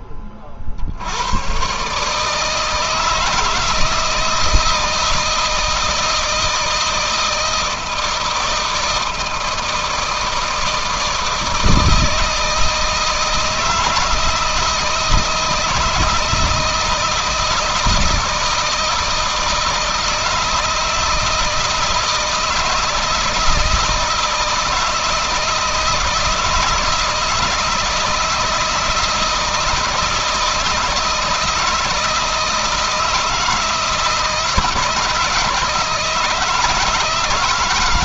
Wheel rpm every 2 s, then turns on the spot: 40, 160, 160, 160, 160, 160, 160, 160, 160, 160, 160, 160, 160, 160, 160, 160, 160, 160, 160.
none